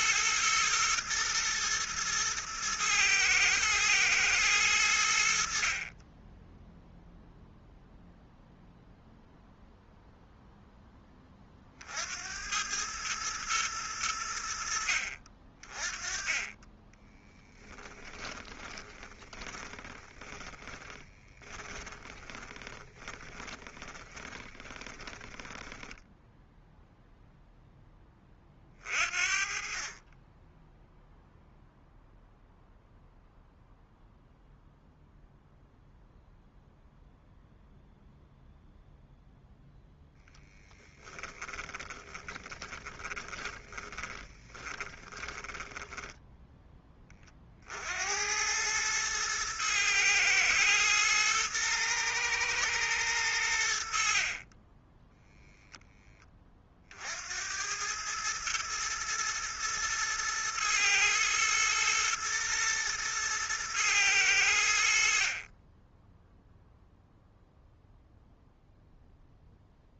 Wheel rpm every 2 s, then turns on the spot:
120, 110, 90, 0, 0, 0, 100, 70, 20, 20, 20, 20, 20, 0, 40, 10, 0, 0, 0, 0, 20, 20, 20, 10, 100, 120, 110, 20, 40, 110, 110, 110, 80, 0, 0.
18-26 40-46